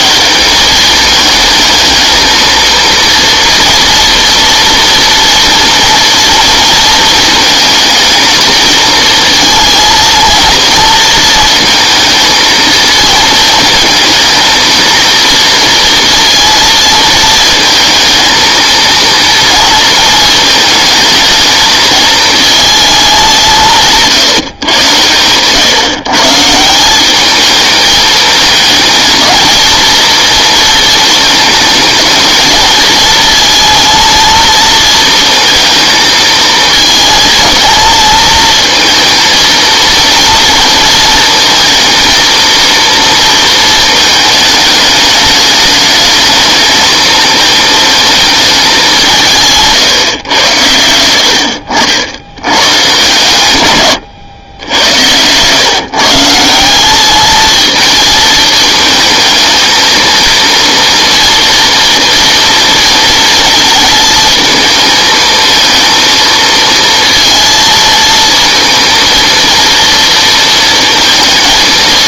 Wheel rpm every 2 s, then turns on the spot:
190, 230, 230, 230, 220, 230, 230, 220, 230, 220, 220, 220, 120, 170, 220, 230, 220, 220, 220, 220, 230, 230, 210, 220, 200, 100, 120, 100, 190, 220, 230, 230, 220, 230, 230, 230.
54-56